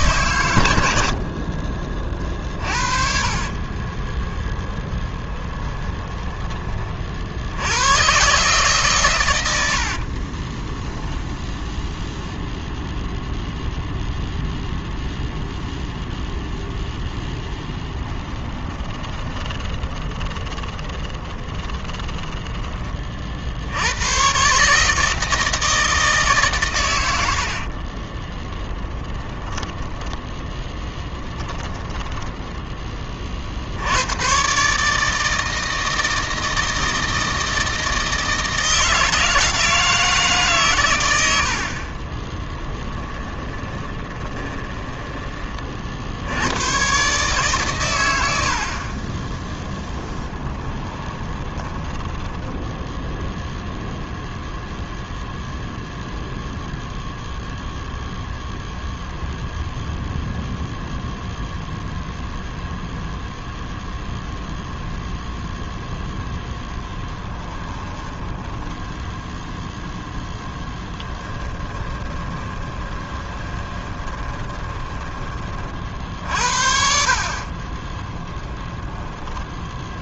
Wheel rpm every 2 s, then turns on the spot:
90, 40, 10, 30, 140, 10, 0, 0, 0, 20, 30, 30, 150, 120, 20, 10, 20, 150, 160, 160, 120, 10, 20, 110, 50, 20, 10, 0, 0, 0, 0, 0, 0, 10, 10, 10, 20, 20, 50, 10.
2-6 10-12 18-22 28-32 42-46 50-54 66-76 78-80